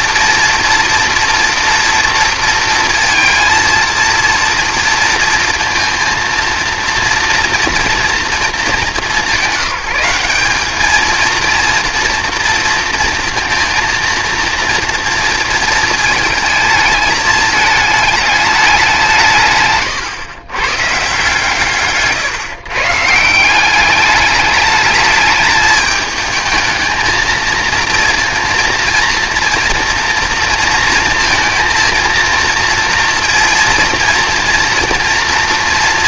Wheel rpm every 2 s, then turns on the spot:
230, 230, 230, 230, 220, 210, 230, 230, 220, 190, 130, 140, 210, 220, 230, 230, 230, 230.
none